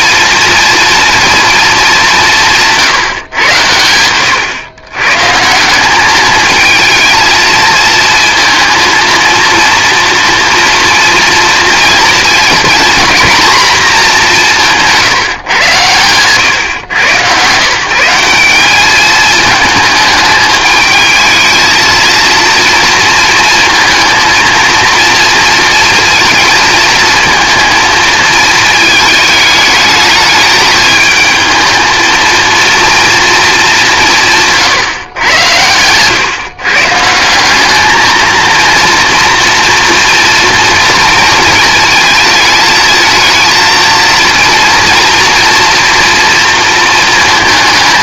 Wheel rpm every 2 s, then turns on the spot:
230, 150, 130, 220, 230, 230, 220, 180, 130, 200, 210, 230, 230, 220, 220, 220, 230, 140, 140, 230, 230, 220, 230, 230.
34-36